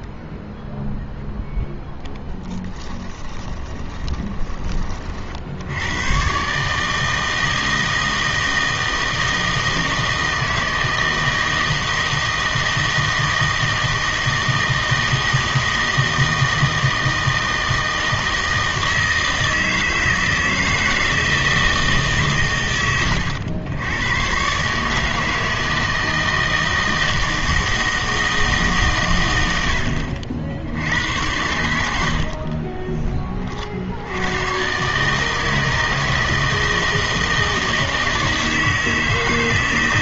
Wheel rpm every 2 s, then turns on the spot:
0, 10, 30, 140, 160, 160, 160, 160, 160, 160, 160, 130, 140, 160, 150, 70, 30, 120, 160, 160.
2-4 32-34